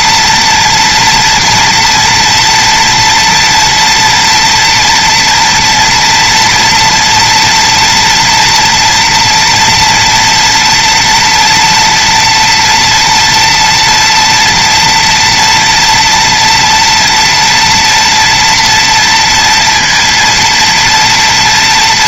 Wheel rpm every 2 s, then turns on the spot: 230, 230, 230, 240, 240, 230, 230, 230, 230, 230, 230.
none